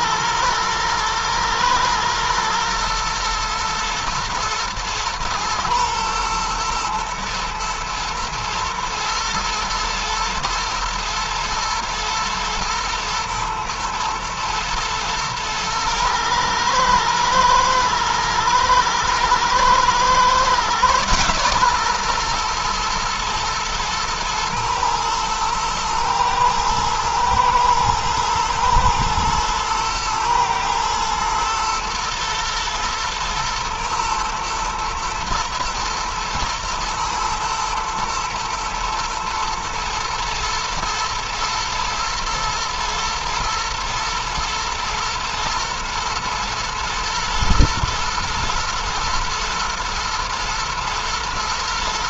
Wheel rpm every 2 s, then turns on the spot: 120, 120, 110, 110, 110, 110, 120, 110, 110, 110, 130, 120, 110, 110, 120, 110, 110, 110, 110, 110, 110, 110, 120, 110, 110, 110.
none